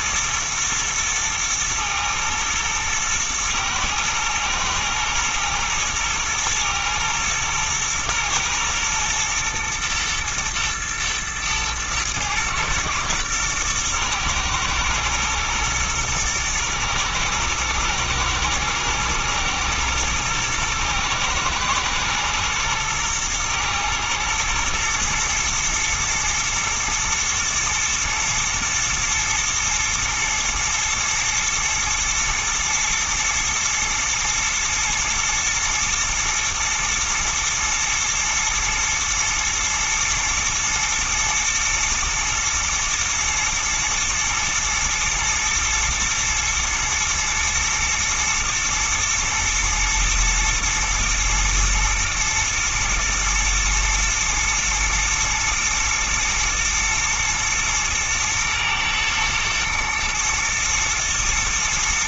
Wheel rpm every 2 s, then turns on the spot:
110, 110, 110, 110, 120, 110, 110, 120, 110, 110, 110, 120, 110, 110, 120, 120, 110, 110, 120, 110, 120, 110, 120, 110, 110, 120, 110, 110, 110, 110, 110.
none